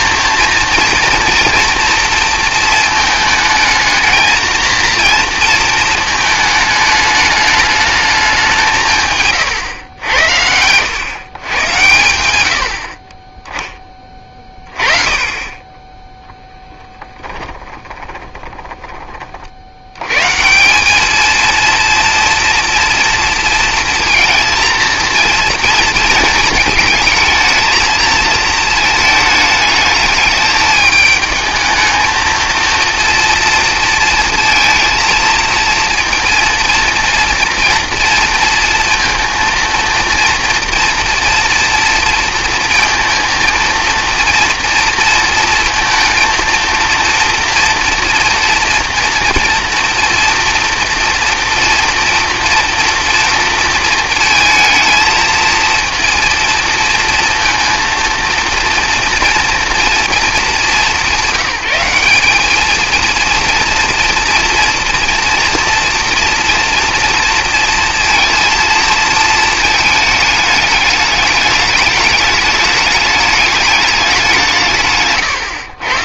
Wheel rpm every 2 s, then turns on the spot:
230, 230, 230, 220, 180, 100, 60, 30, 10, 30, 170, 230, 230, 230, 220, 210, 230, 230, 230, 230, 230, 230, 230, 230, 230, 240, 230, 220, 230, 230, 210, 210, 240, 230, 230, 210, 210, 160.
12-14 16-20